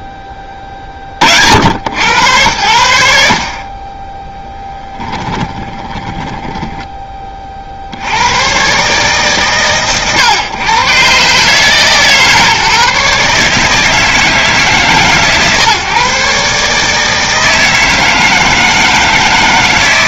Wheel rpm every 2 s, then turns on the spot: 10, 80, 20, 20, 130, 110, 150, 140, 150, 160.
4-6